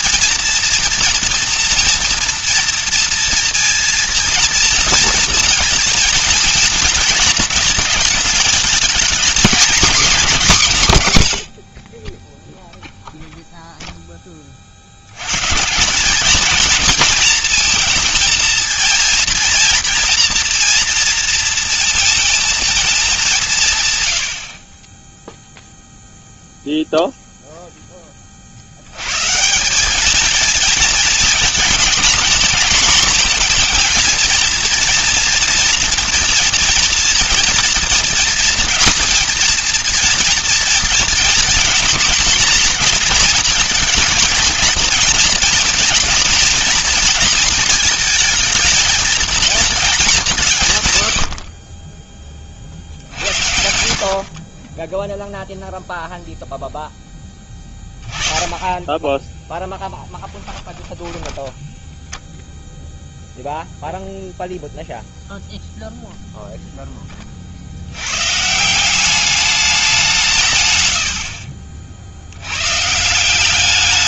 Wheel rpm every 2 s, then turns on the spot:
230, 230, 230, 230, 220, 190, 0, 30, 230, 230, 230, 230, 50, 0, 60, 220, 230, 230, 230, 230, 230, 240, 240, 230, 230, 160, 30, 30, 0, 20, 10, 0, 0, 0, 150, 140, 110.
60-62